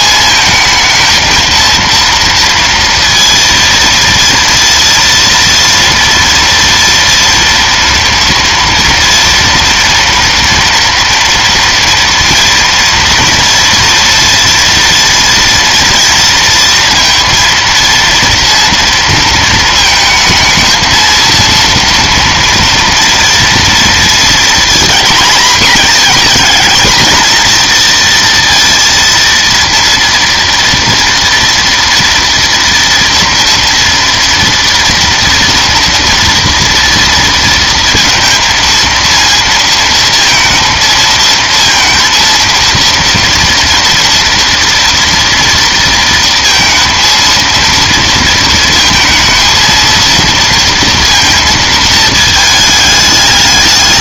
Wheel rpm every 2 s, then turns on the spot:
220, 230, 230, 230, 240, 230, 230, 230, 230, 230, 220, 230, 230, 220, 230, 230, 230, 230, 230, 230, 230, 230, 230, 230, 230, 230, 220.
none